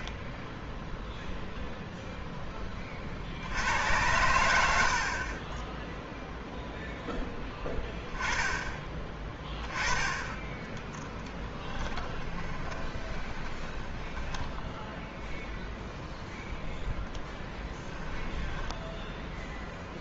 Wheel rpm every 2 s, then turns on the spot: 0, 20, 70, 0, 20, 10, 20, 10, 0, 10.
12-16